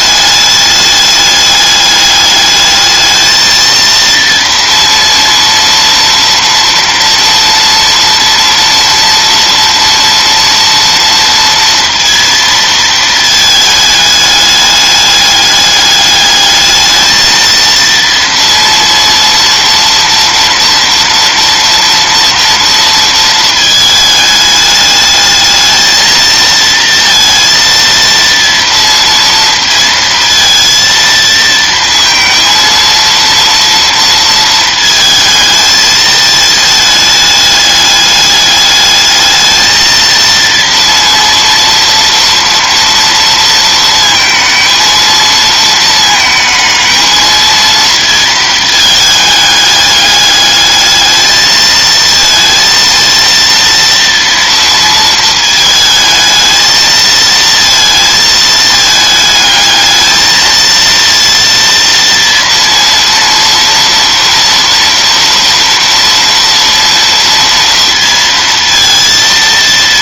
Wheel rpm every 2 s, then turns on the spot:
210, 220, 230, 230, 230, 230, 220, 210, 220, 230, 230, 230, 210, 230, 230, 230, 230, 220, 210, 210, 230, 230, 220, 220, 220, 210, 230, 230, 220, 220, 230, 230, 230, 230, 230.
none